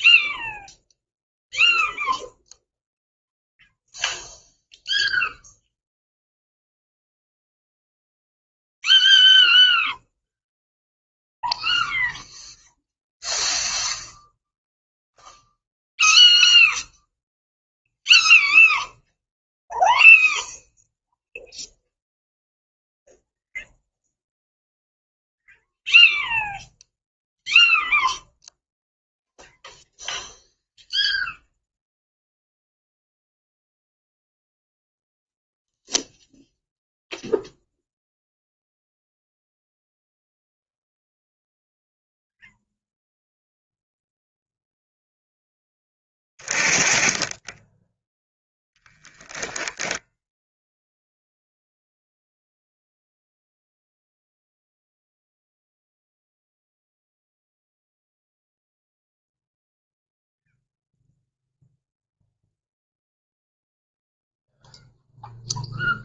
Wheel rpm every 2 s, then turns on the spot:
0, 0, 0, 0, 0, 0, 0, 0, 0, 0, 0, 0, 0, 0, 0, 0, 0, 0, 0, 0, 0, 0, 0, 20, 10, 0, 0, 0, 0, 0, 0, 0, 0.
none